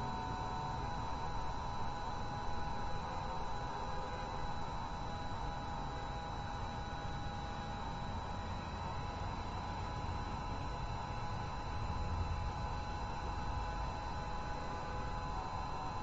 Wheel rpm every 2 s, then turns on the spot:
0, 0, 0, 0, 0, 0, 0, 0.
none